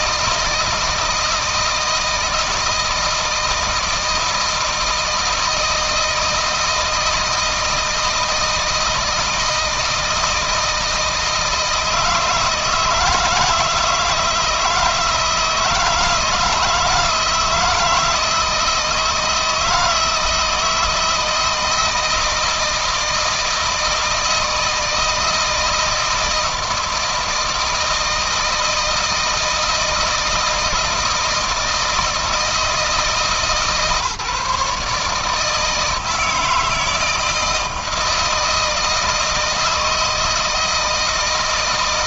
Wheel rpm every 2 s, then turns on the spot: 160, 160, 160, 160, 160, 160, 160, 160, 160, 160, 160, 160, 160, 160, 160, 160, 160, 150, 160, 160, 160.
none